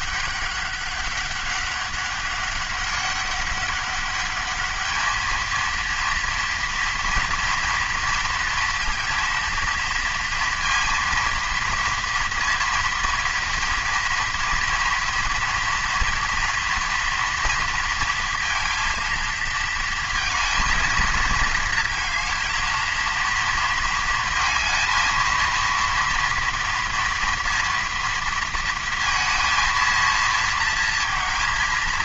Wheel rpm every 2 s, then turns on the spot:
200, 200, 210, 230, 230, 230, 230, 230, 230, 230, 230, 230, 230, 230, 230, 230.
none